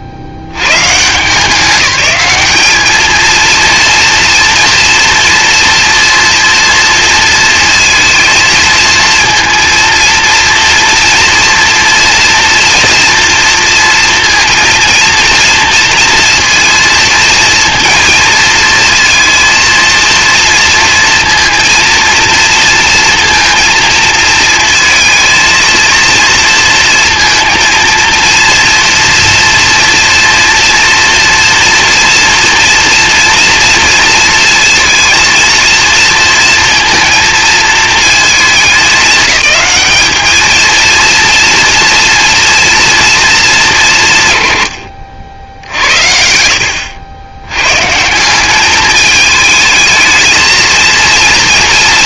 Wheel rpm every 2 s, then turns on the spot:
110, 200, 230, 230, 230, 230, 230, 230, 230, 230, 230, 230, 230, 230, 230, 230, 230, 230, 230, 210, 230, 240, 110, 90, 200, 230.
none